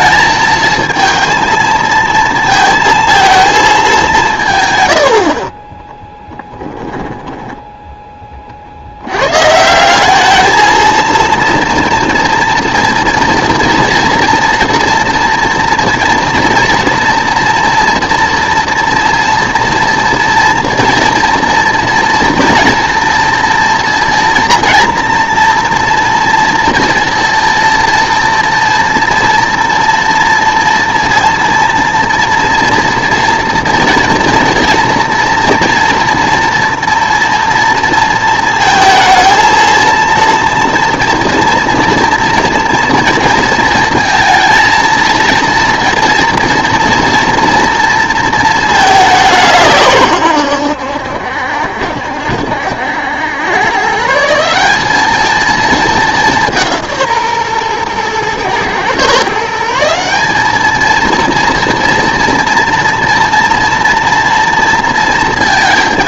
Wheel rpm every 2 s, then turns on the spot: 220, 230, 130, 20, 60, 220, 230, 230, 230, 230, 230, 230, 230, 230, 230, 230, 230, 240, 230, 220, 230, 230, 230, 230, 210, 90, 70, 180, 170, 120, 210, 230, 230.
6-8